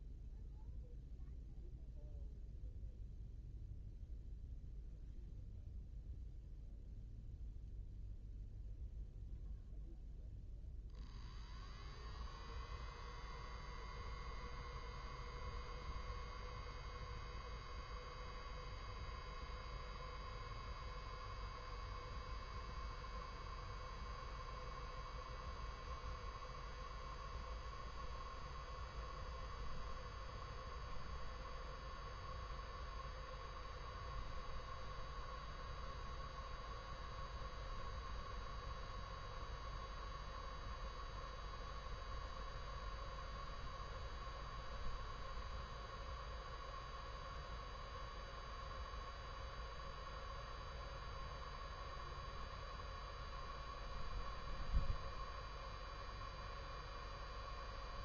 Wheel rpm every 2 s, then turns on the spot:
0, 0, 0, 0, 0, 0, 0, 0, 0, 0, 0, 0, 0, 0, 0, 0, 0, 0, 0, 0, 0, 0, 0, 0, 0, 0, 0, 0, 0.
none